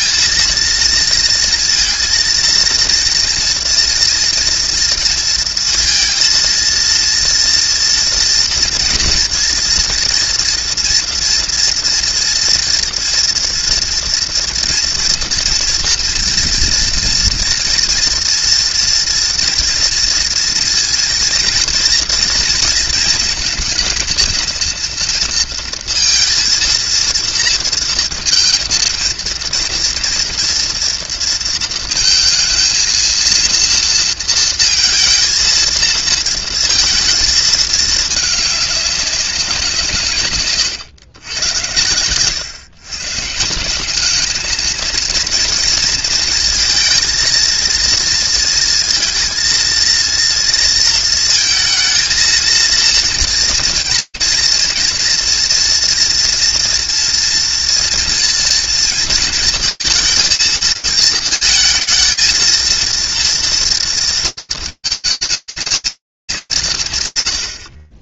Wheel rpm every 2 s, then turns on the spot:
230, 230, 230, 230, 230, 230, 230, 230, 230, 230, 230, 230, 230, 230, 230, 230, 230, 230, 230, 200, 120, 130, 220, 220, 230, 230, 230, 230, 230, 230, 220, 230, 220, 200.
none